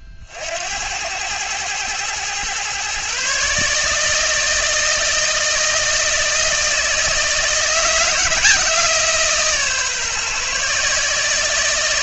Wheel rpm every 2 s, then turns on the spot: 80, 130, 160, 160, 150, 150.
none